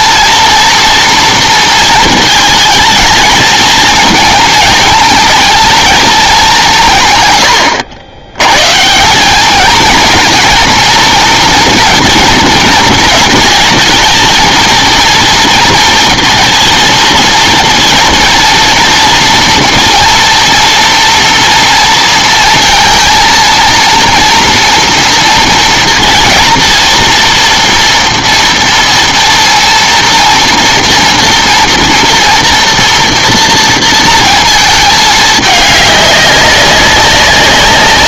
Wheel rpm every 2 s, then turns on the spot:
230, 230, 220, 180, 130, 220, 220, 220, 230, 240, 230, 230, 230, 230, 230, 230, 230, 220, 200.
none